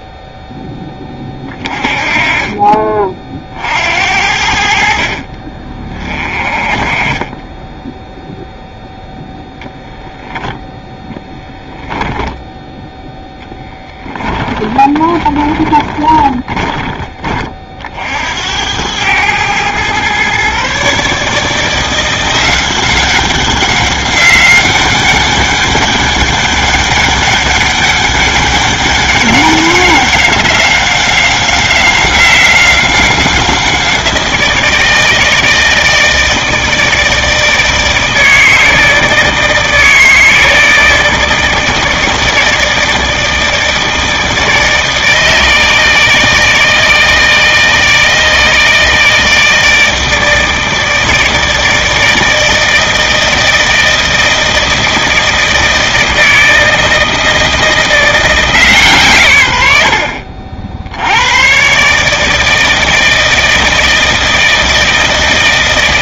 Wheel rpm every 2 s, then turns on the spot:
10, 30, 50, 30, 0, 10, 0, 20, 20, 90, 140, 190, 190, 200, 190, 190, 190, 160, 160, 160, 160, 160, 160, 160, 160, 160, 160, 160, 160, 150, 70, 160, 160.
14-16